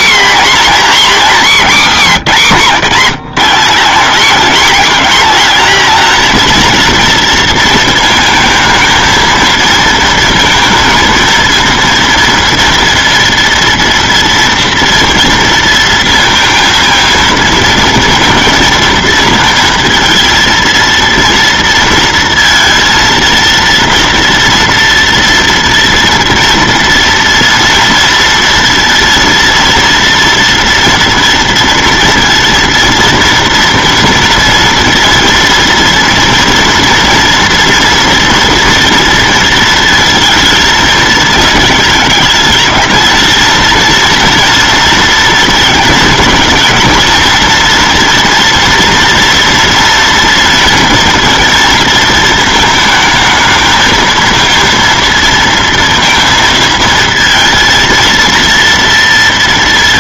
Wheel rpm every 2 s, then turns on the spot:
240, 180, 220, 230, 220, 230, 230, 230, 230, 230, 230, 230, 240, 230, 230, 230, 230, 230, 230, 230, 220, 210, 230, 220, 230, 230, 220, 230, 230, 230.
none